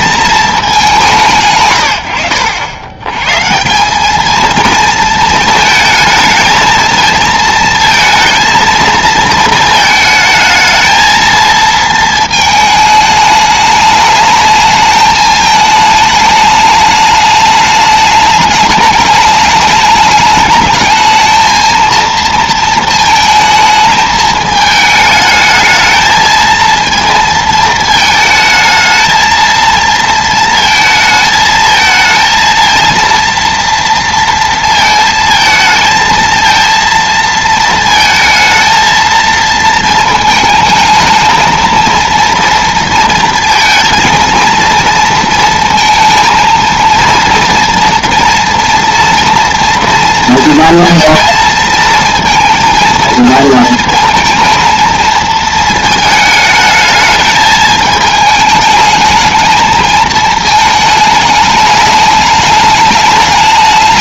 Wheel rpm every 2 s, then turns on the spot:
200, 90, 230, 220, 230, 220, 220, 210, 210, 210, 210, 230, 220, 230, 220, 220, 230, 230, 230, 220, 220, 230, 230, 230, 230, 230, 230, 230, 220, 210, 220, 210.
none